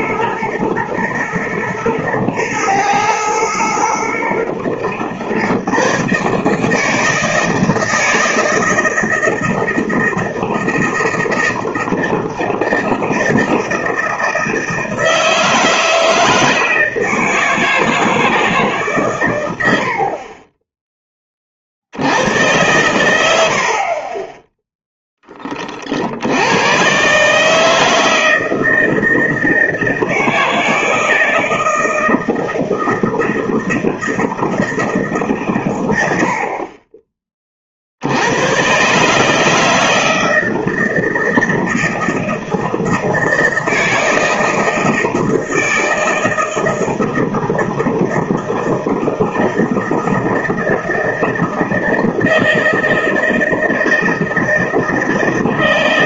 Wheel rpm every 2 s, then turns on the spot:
110, 110, 120, 150, 160, 160, 160, 160, 160, 140, 10, 110, 10, 110, 160, 160, 160, 160, 30, 120, 160, 160, 160, 160, 160, 160, 160, 160.
none